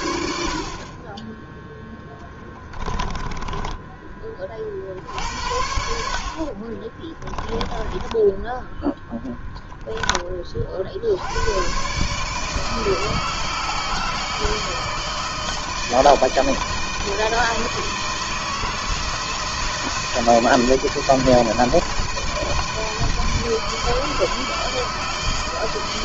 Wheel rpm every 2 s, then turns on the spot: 60, 20, 30, 40, 10, 40, 150, 160, 160, 160, 160, 160, 160.
2-4 6-8